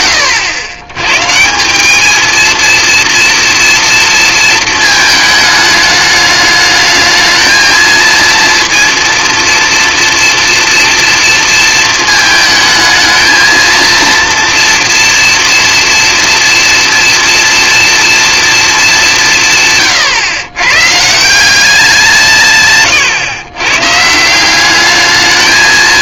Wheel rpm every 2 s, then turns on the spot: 130, 240, 220, 220, 230, 230, 220, 230, 230, 190, 150, 130, 210.
none